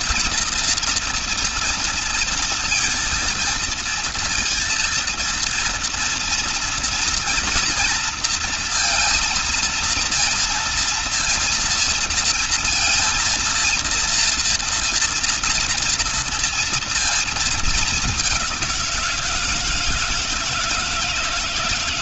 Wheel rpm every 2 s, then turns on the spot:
240, 230, 230, 230, 230, 230, 230, 230, 230, 190, 160.
none